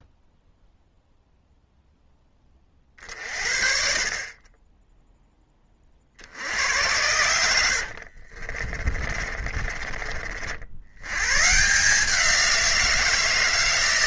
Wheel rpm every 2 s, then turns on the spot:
0, 40, 20, 90, 40, 60, 170.
8-10